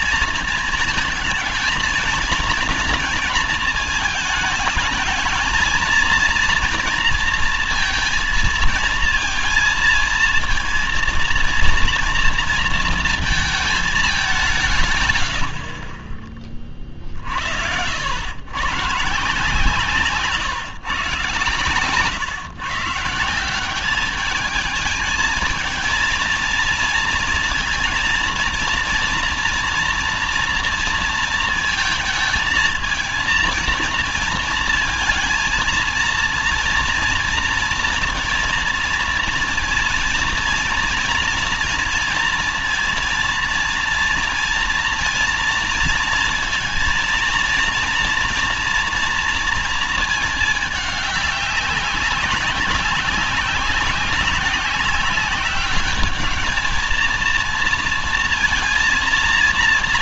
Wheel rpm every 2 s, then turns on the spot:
220, 230, 220, 230, 220, 230, 230, 170, 30, 120, 140, 130, 210, 230, 230, 230, 230, 230, 230, 230, 230, 240, 230, 230, 230, 220, 200, 190, 210, 230.
none